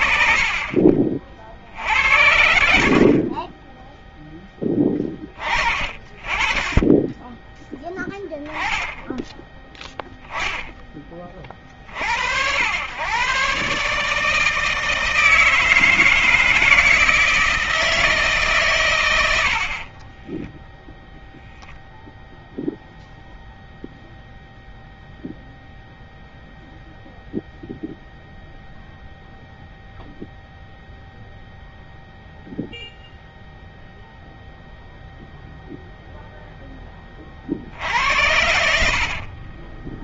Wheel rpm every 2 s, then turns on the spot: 50, 50, 20, 20, 10, 20, 110, 160, 160, 100, 0, 0, 0, 0, 0, 0, 0, 0, 20, 60.
38-40